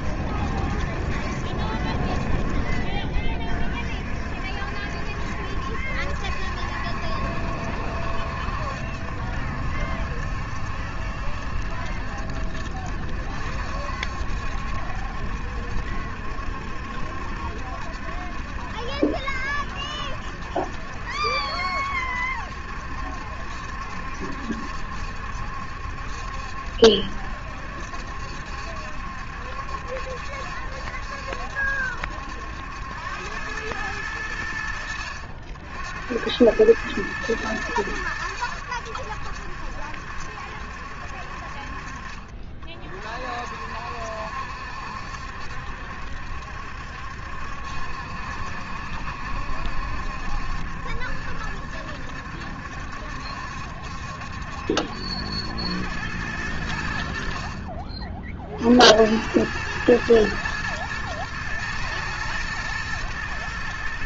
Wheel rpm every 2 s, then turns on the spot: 70, 40, 60, 70, 70, 70, 70, 70, 70, 70, 70, 70, 70, 70, 70, 70, 80, 80, 100, 90, 70, 40, 70, 70, 70, 70, 70, 70, 90, 60, 110, 110.
none